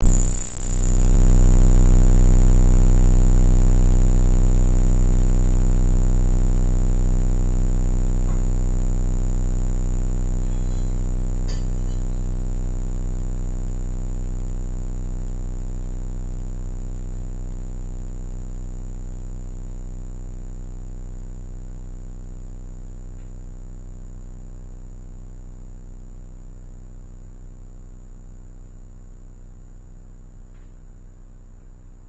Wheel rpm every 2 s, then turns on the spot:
0, 0, 0, 0, 0, 0, 0, 0, 0, 0, 0, 0, 0, 0, 0, 0.
none